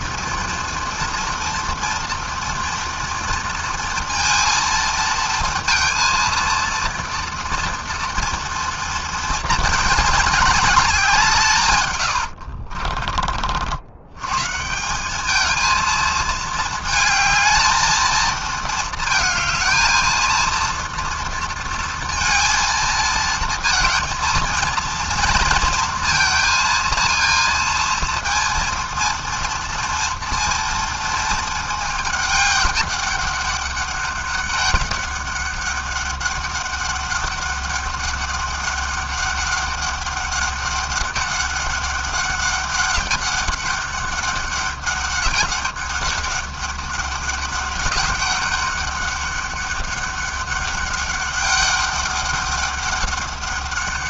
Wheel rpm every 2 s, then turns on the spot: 230, 230, 230, 230, 220, 170, 40, 200, 220, 220, 230, 230, 230, 230, 230, 220, 200, 200, 200, 200, 200, 190, 200, 200, 200, 200, 200.
none